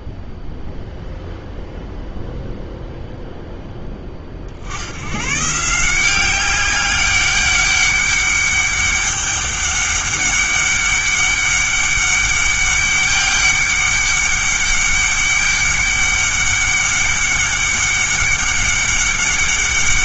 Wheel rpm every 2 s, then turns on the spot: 0, 0, 80, 190, 200, 200, 200, 200, 200, 200.
none